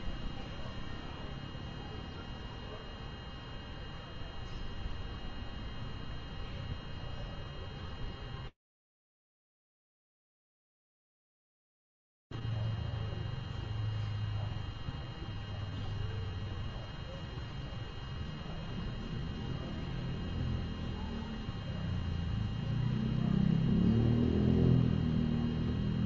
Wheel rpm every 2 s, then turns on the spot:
0, 0, 0, 0, 0, 0, 0, 0, 0, 0, 0, 0, 0.
none